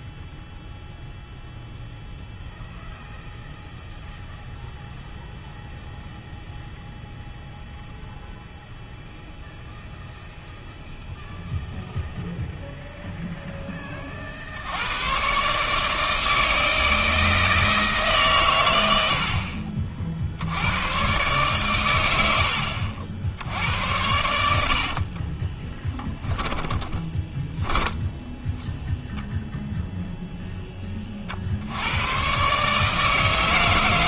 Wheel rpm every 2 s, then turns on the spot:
0, 0, 0, 0, 0, 0, 0, 90, 160, 90, 100, 70, 70, 20, 0, 30, 150.
26-28